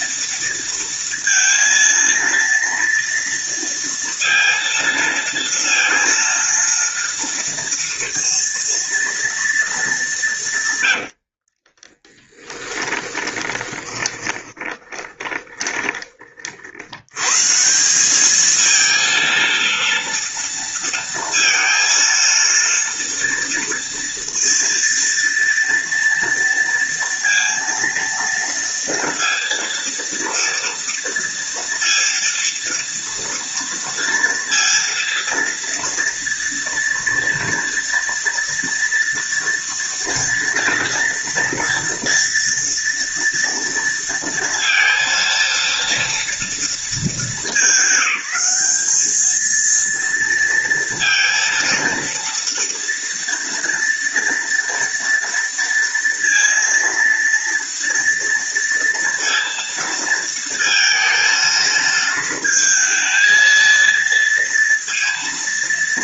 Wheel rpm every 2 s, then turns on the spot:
230, 230, 230, 230, 230, 130, 20, 20, 70, 220, 230, 230, 230, 230, 230, 230, 230, 230, 230, 230, 230, 230, 230, 210, 200, 230, 230, 230, 230, 230, 230, 220, 230.
10-16